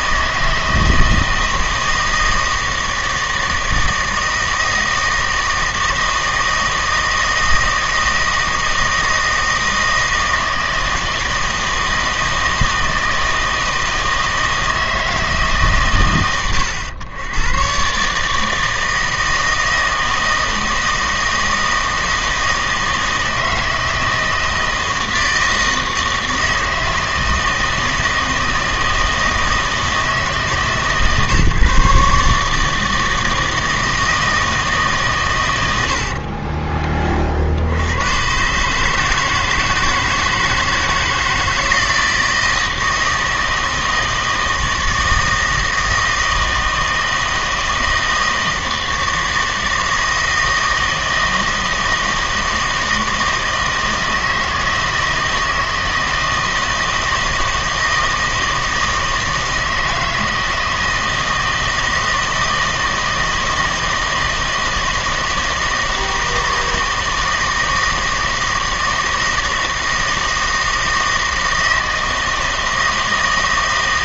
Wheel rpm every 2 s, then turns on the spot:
160, 160, 160, 160, 160, 160, 160, 160, 100, 160, 160, 160, 160, 160, 160, 150, 160, 150, 30, 140, 160, 160, 160, 160, 160, 160, 160, 160, 160, 160, 160, 160, 160, 160, 160, 160, 160.
36-38